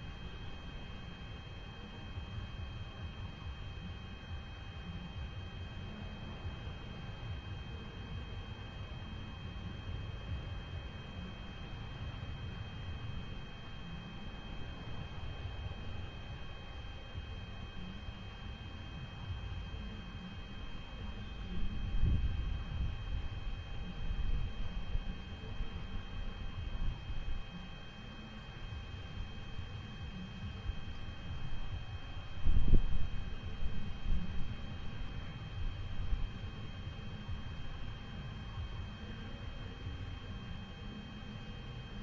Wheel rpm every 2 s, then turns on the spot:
0, 0, 0, 0, 0, 0, 0, 0, 0, 0, 0, 0, 0, 0, 0, 0, 0, 0, 0, 0, 0.
none